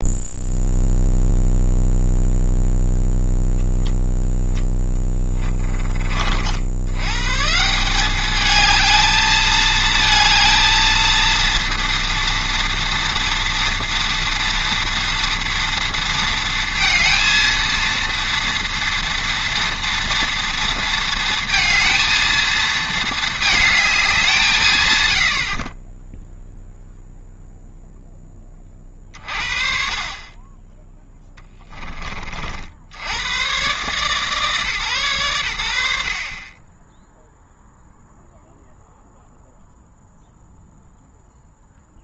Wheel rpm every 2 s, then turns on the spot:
0, 0, 10, 110, 220, 230, 230, 230, 230, 230, 230, 220, 110, 0, 40, 10, 60, 130, 10, 0, 0.
none